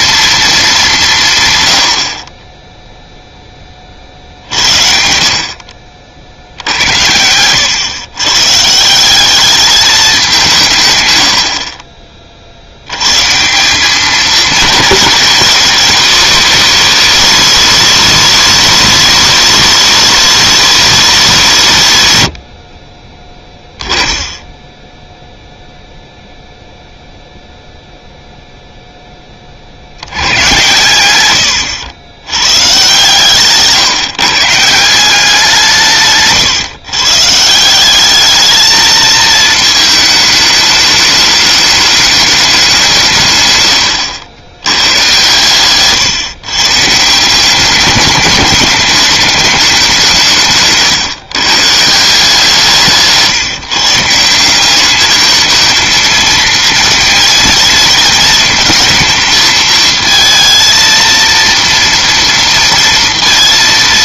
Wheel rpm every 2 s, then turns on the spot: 210, 10, 70, 70, 150, 150, 80, 210, 190, 190, 180, 50, 10, 0, 0, 120, 130, 170, 140, 220, 210, 190, 100, 140, 210, 150, 170, 190, 230, 220, 230, 230.
6-8 50-52